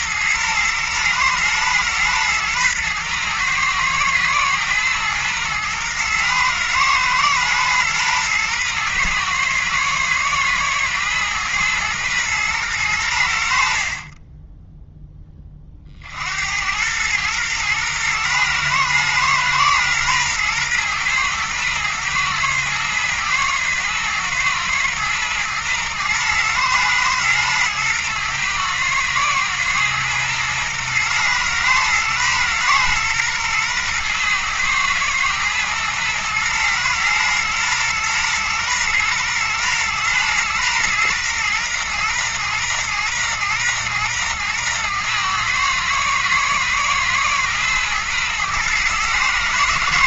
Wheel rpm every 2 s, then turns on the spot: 120, 120, 120, 120, 120, 110, 100, 0, 100, 120, 120, 110, 110, 110, 110, 120, 120, 120, 110, 120, 120, 120, 110, 110, 110.
none